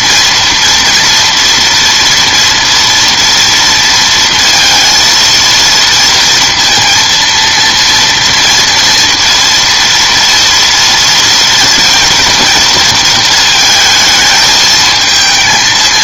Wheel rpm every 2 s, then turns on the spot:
240, 230, 230, 230, 230, 230, 230, 220.
none